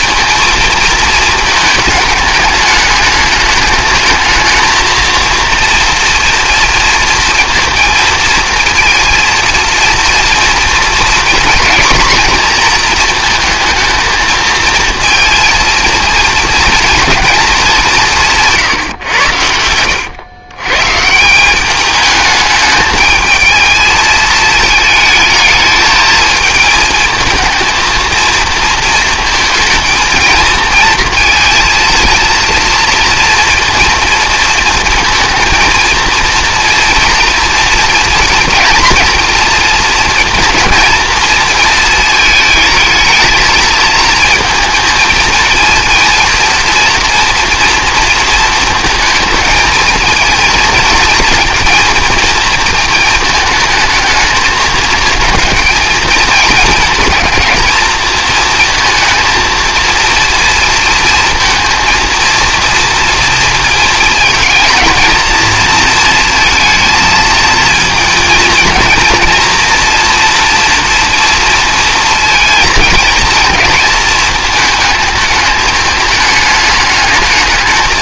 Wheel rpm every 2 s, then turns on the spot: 220, 210, 220, 230, 230, 230, 240, 230, 230, 140, 140, 210, 220, 220, 230, 230, 230, 230, 230, 230, 230, 220, 230, 230, 230, 230, 220, 220, 220, 230, 230, 230, 220, 220, 230, 230, 220, 220, 210.
18-20